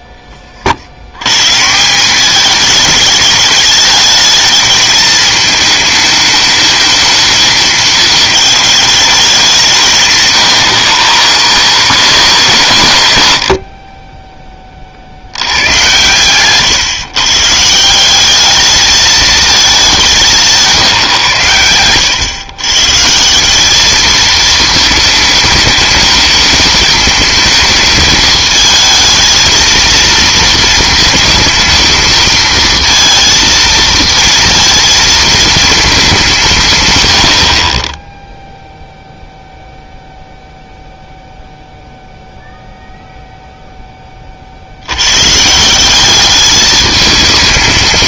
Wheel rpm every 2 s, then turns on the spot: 50, 210, 210, 220, 210, 130, 120, 30, 130, 210, 170, 130, 220, 220, 220, 230, 230, 230, 140, 0, 0, 0, 70, 210.
none